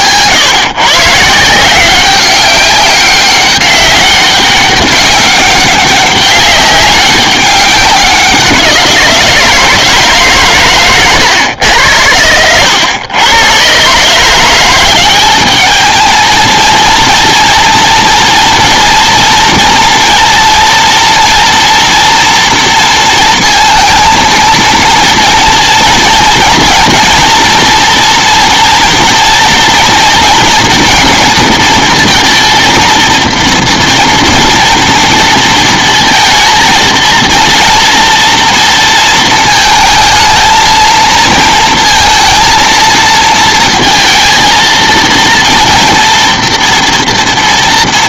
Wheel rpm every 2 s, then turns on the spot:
130, 200, 200, 200, 180, 130, 100, 180, 230, 230, 230, 230, 230, 230, 230, 230, 230, 230, 220, 230, 220, 230, 230, 240.
none